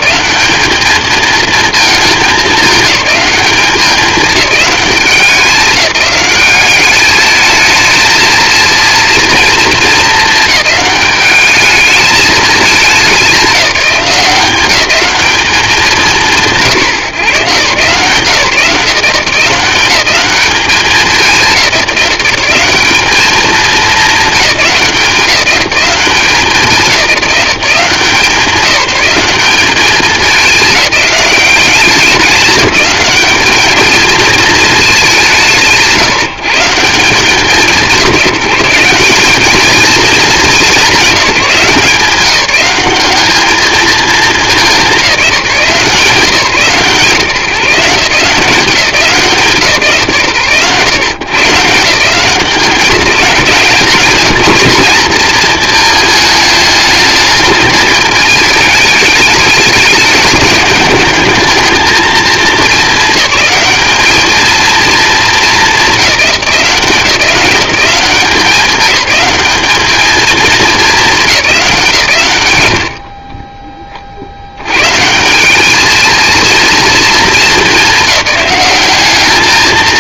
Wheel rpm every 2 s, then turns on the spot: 220, 200, 200, 210, 230, 210, 200, 200, 160, 170, 200, 200, 190, 200, 190, 200, 200, 200, 170, 190, 200, 190, 190, 150, 170, 120, 190, 210, 220, 210, 220, 210, 210, 170, 190, 210, 70, 130, 230, 200.
72-74